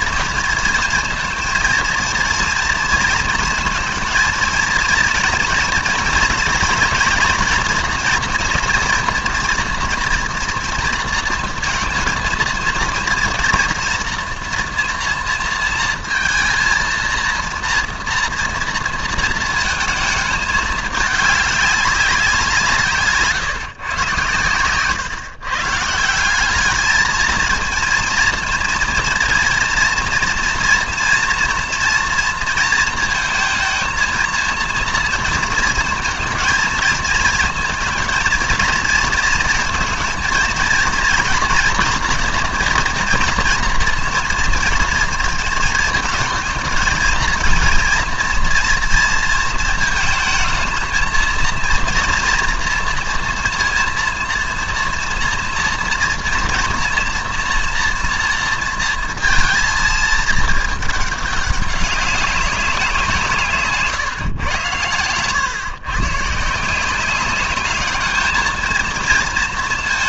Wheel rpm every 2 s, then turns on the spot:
230, 230, 230, 230, 230, 230, 230, 240, 230, 230, 210, 170, 120, 210, 230, 240, 230, 230, 230, 230, 230, 240, 240, 220, 230, 220, 230, 230, 230, 230, 220, 190, 120, 170, 220.
none